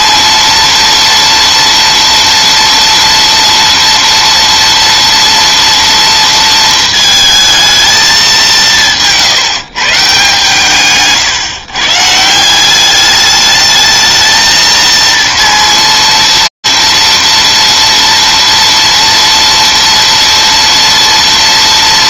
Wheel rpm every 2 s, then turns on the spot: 230, 230, 230, 230, 200, 140, 170, 220, 230, 230, 230.
none